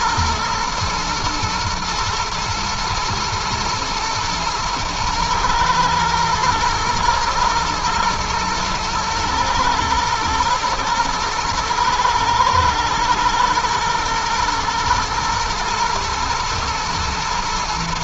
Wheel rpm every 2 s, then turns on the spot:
110, 120, 110, 120, 110, 120, 110, 120, 120.
none